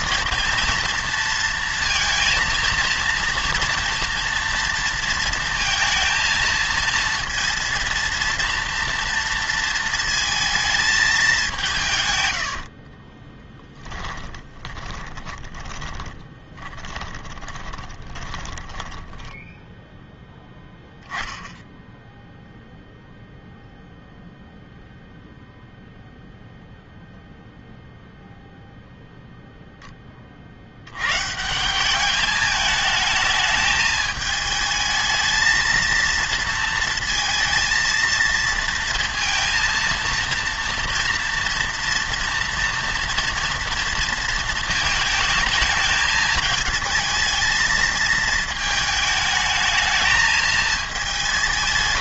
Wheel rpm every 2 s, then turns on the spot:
230, 230, 230, 230, 230, 220, 70, 20, 20, 10, 10, 0, 0, 0, 0, 80, 210, 220, 230, 230, 230, 240, 220, 220, 220, 220.
12-20